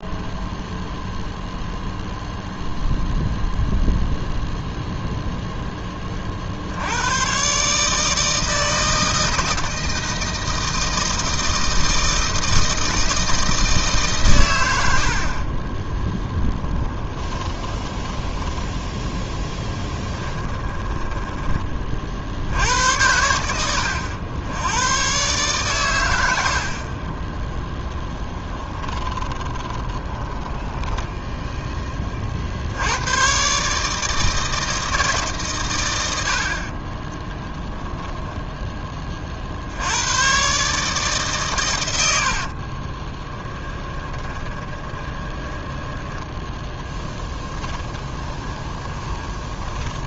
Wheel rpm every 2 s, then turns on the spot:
0, 0, 0, 80, 160, 160, 160, 80, 20, 10, 20, 80, 110, 50, 10, 10, 80, 160, 30, 20, 150, 40, 20, 10, 20.
16-18 20-22 28-32 36-38 42-50